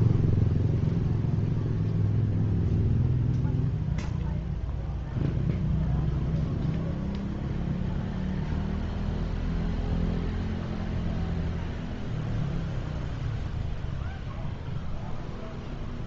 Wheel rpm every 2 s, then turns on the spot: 0, 0, 0, 0, 0, 0, 0, 0.
none